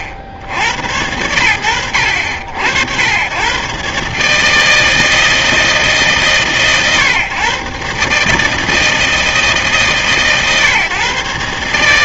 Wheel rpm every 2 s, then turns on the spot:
40, 90, 150, 130, 140, 140.
none